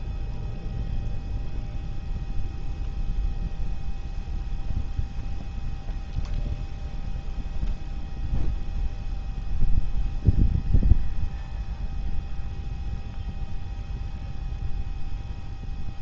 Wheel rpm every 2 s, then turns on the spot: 0, 0, 0, 0, 0, 0, 0, 0.
none